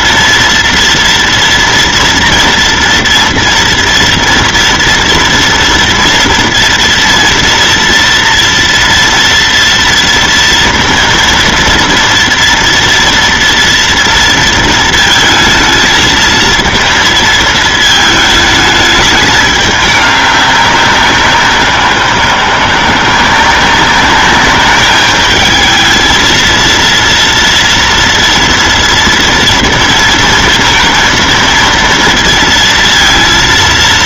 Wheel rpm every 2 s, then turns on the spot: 230, 230, 230, 230, 230, 230, 230, 230, 220, 220, 200, 170, 210, 230, 230, 230, 230.
none